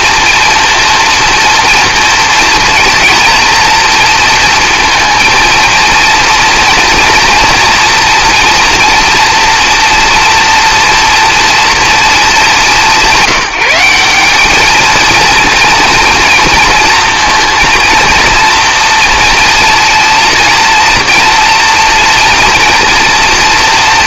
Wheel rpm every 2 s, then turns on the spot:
230, 230, 230, 230, 230, 230, 200, 220, 230, 230, 230, 240.
none